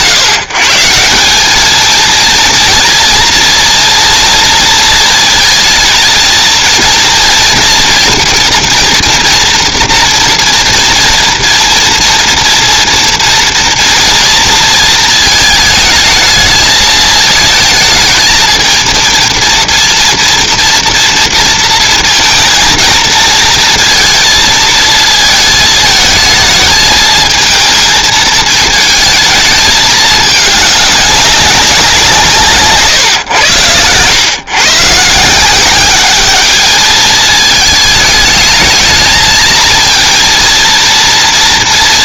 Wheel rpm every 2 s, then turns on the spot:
160, 230, 240, 230, 240, 230, 230, 230, 220, 220, 230, 230, 230, 220, 220, 200, 150, 130, 210, 220, 230.
none